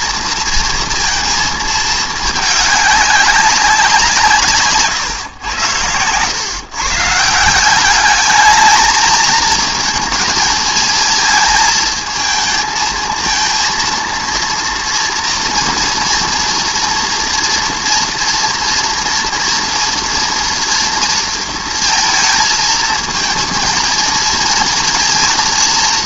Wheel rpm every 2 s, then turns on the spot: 230, 200, 140, 130, 220, 230, 220, 240, 230, 230, 230, 220, 230.
4-6